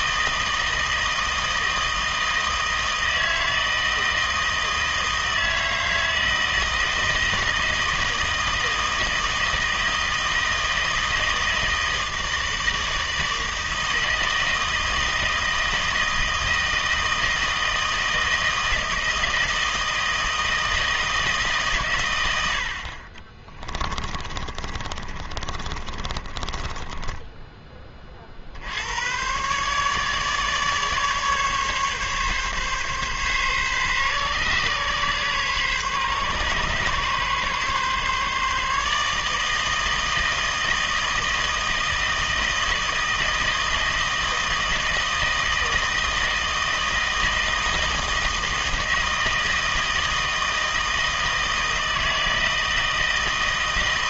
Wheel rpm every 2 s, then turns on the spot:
160, 160, 160, 160, 160, 160, 160, 160, 160, 160, 160, 60, 30, 20, 70, 150, 140, 130, 140, 150, 160, 160, 160, 160, 160, 160, 160.
24-28